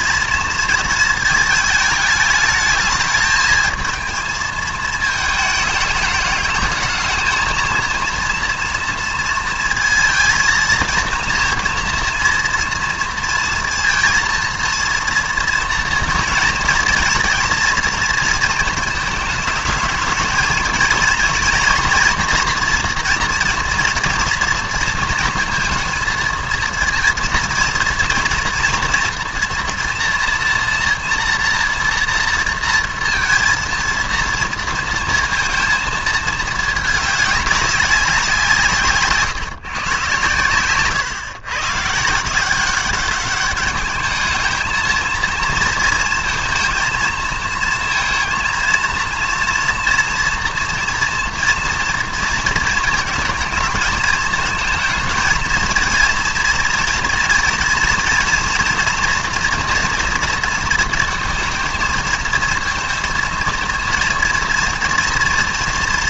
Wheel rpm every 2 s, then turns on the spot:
220, 210, 220, 210, 230, 230, 230, 230, 230, 230, 220, 230, 230, 230, 230, 230, 230, 230, 210, 150, 130, 190, 220, 230, 230, 230, 220, 230, 230, 230, 230, 220, 230.
none